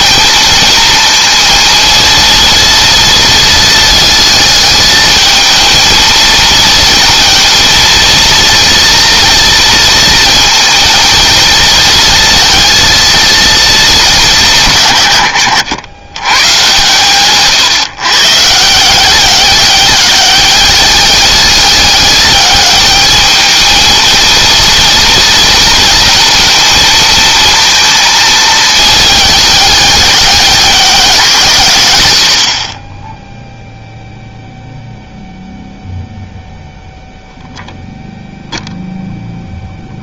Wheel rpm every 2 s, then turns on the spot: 230, 230, 220, 230, 230, 230, 230, 120, 130, 170, 200, 210, 230, 230, 220, 190, 30, 0, 0, 0.
none